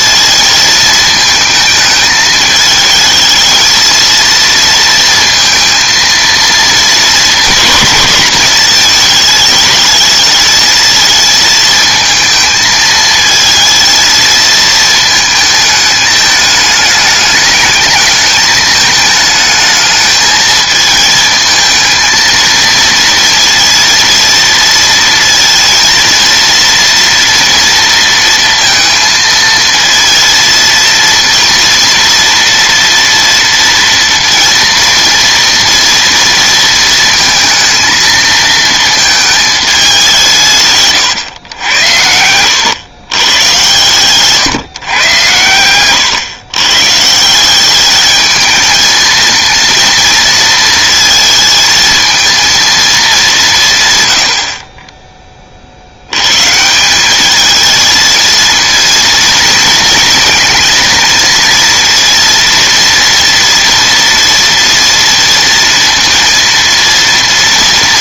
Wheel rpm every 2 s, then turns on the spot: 220, 220, 230, 220, 210, 220, 220, 220, 210, 210, 220, 230, 230, 230, 230, 230, 230, 230, 230, 220, 150, 100, 140, 130, 220, 230, 230, 50, 150, 220, 230, 230, 230, 230.
none